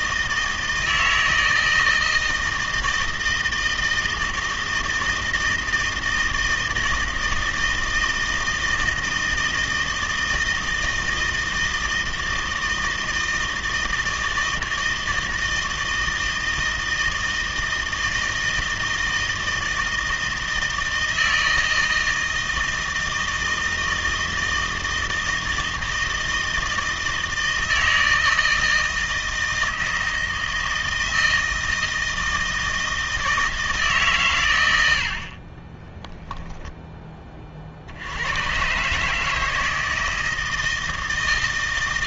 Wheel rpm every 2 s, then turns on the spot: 160, 160, 160, 160, 160, 160, 160, 160, 160, 160, 160, 160, 160, 160, 160, 160, 160, 80, 10, 140, 160.
none